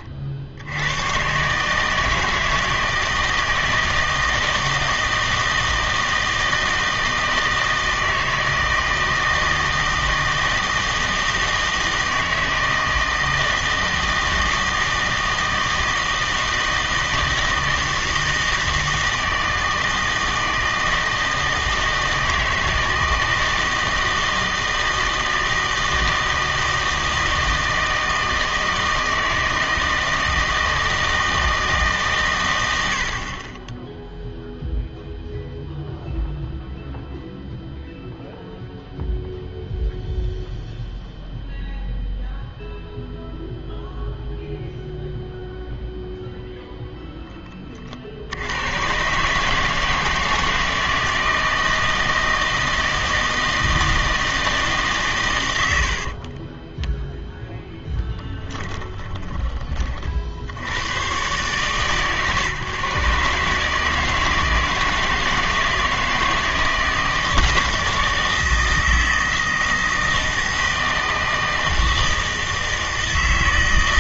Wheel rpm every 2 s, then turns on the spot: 80, 160, 160, 160, 160, 160, 160, 160, 160, 160, 160, 160, 160, 160, 160, 160, 90, 0, 0, 0, 0, 0, 0, 0, 100, 160, 160, 150, 20, 10, 70, 130, 160, 160, 160, 160, 160.
56-60